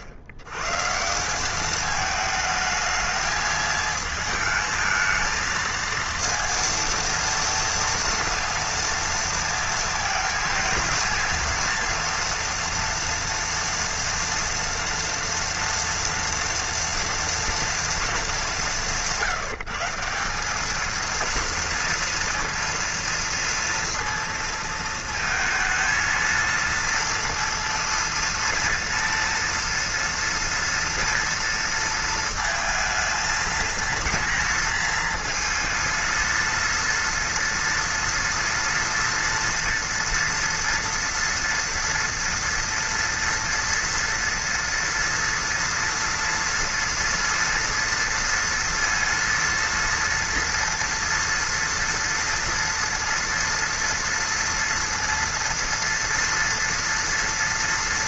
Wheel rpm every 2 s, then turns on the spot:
100, 220, 220, 230, 230, 230, 230, 230, 230, 190, 210, 230, 230, 230, 230, 230, 230, 230, 230, 230, 230, 230, 230, 230, 230, 230, 230, 230, 230.
none